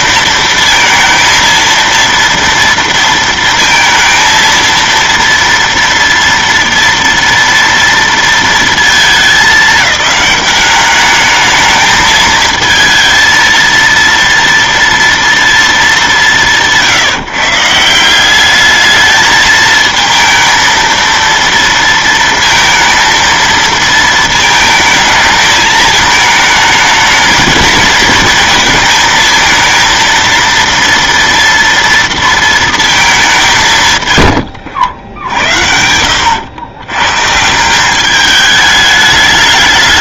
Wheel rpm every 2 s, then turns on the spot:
230, 230, 230, 230, 230, 210, 230, 230, 170, 210, 230, 230, 220, 220, 220, 230, 220, 100, 110, 210.
none